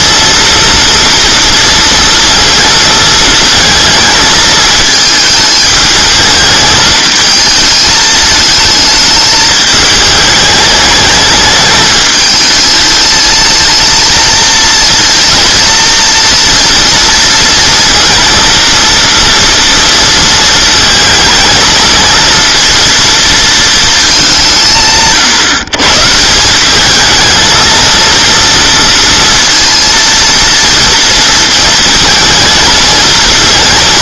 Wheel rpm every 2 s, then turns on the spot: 230, 230, 220, 220, 220, 210, 220, 230, 230, 230, 220, 230, 150, 190, 230, 230, 220.
none